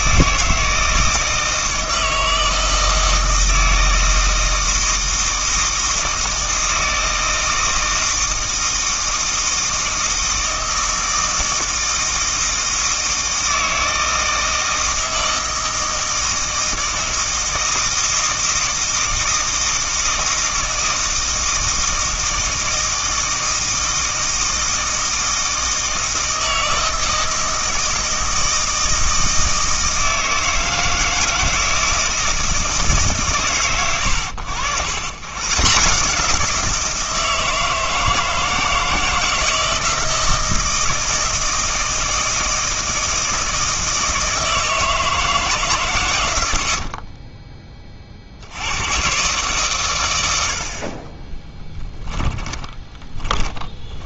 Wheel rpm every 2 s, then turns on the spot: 160, 160, 160, 160, 160, 160, 160, 160, 160, 160, 160, 160, 160, 160, 160, 160, 160, 100, 160, 160, 160, 160, 160, 60, 100, 40, 20.
46-48 50-54